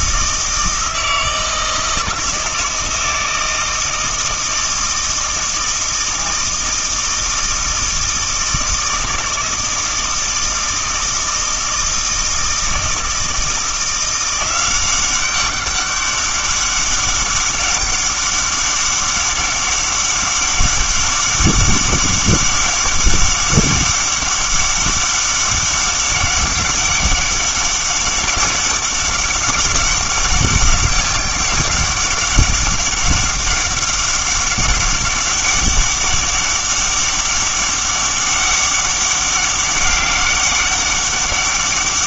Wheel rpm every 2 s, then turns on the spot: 160, 160, 160, 160, 160, 160, 160, 180, 200, 200, 200, 200, 200, 200, 200, 200, 200, 200, 200, 200, 200.
none